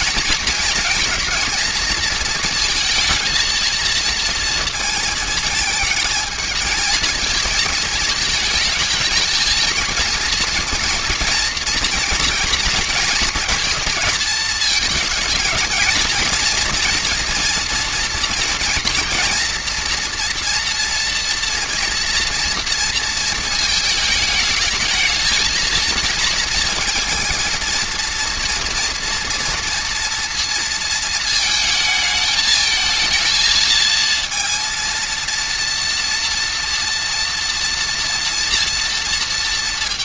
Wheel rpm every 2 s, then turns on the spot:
220, 230, 230, 220, 220, 230, 230, 220, 230, 230, 240, 230, 220, 230, 230, 230, 220, 230, 230, 230.
none